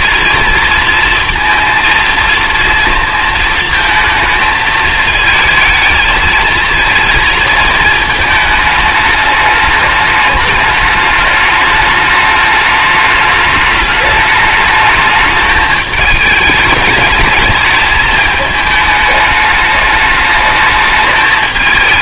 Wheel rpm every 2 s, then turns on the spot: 230, 230, 220, 220, 220, 210, 210, 210, 210, 210, 210.
none